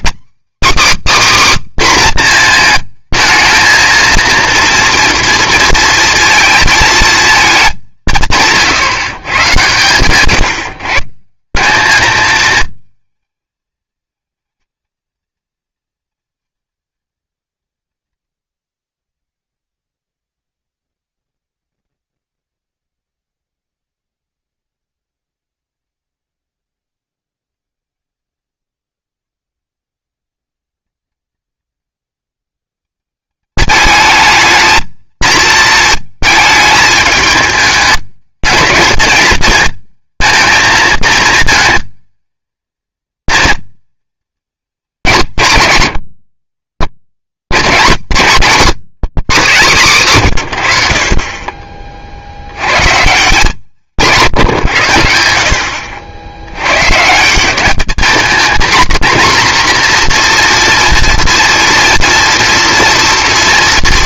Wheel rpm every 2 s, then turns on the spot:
290, 230, 230, 230, 150, 130, 220, 220, 220, 100, 170, 210, 210, 180, 140, 210, 210, 220, 220, 210, 220, 220, 200, 60, 170, 110, 120, 110, 110, 230, 240, 230.
none